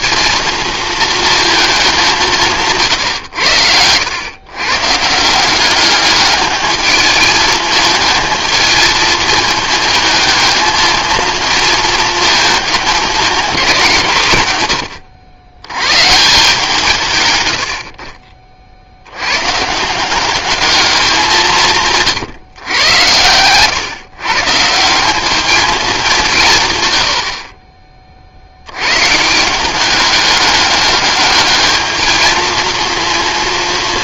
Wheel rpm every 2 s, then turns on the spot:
230, 150, 130, 210, 220, 220, 220, 120, 140, 50, 210, 120, 160, 140, 90, 200, 230.
none